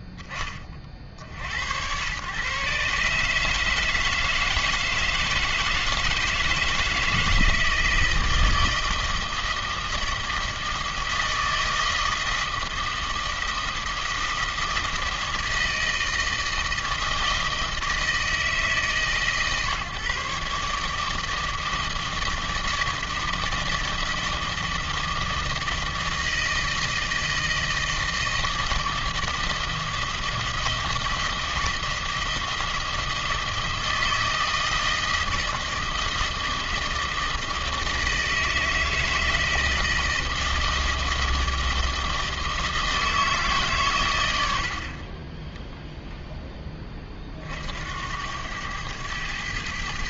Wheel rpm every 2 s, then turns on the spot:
20, 120, 160, 160, 160, 160, 160, 160, 160, 160, 150, 160, 160, 160, 160, 160, 160, 160, 160, 160, 160, 160, 90, 10, 100.
none